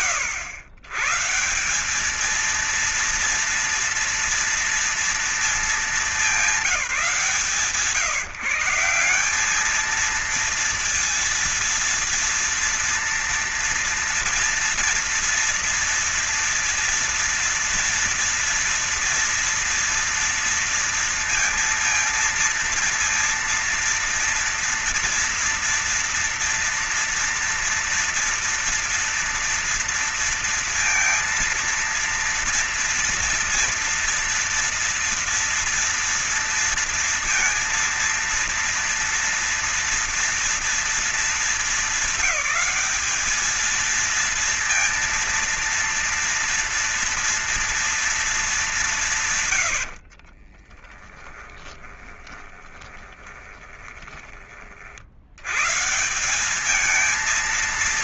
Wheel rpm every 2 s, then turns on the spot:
130, 230, 230, 170, 170, 230, 230, 230, 240, 230, 230, 230, 230, 230, 230, 230, 230, 240, 230, 230, 230, 200, 230, 230, 190, 20, 20, 40, 200.
50-54